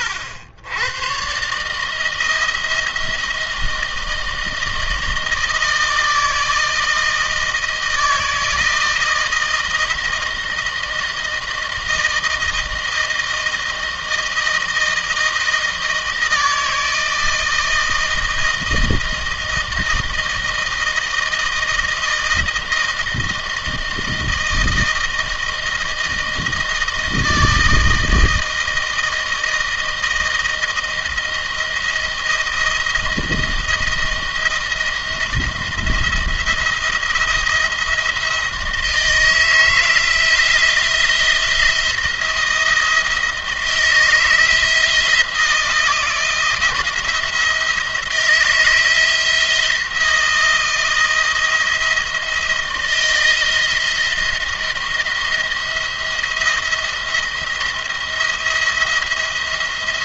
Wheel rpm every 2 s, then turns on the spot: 100, 170, 160, 160, 160, 160, 160, 160, 160, 160, 160, 160, 160, 160, 160, 160, 170, 160, 170, 160, 160, 170, 160, 170, 170, 170, 170, 170, 170, 170.
none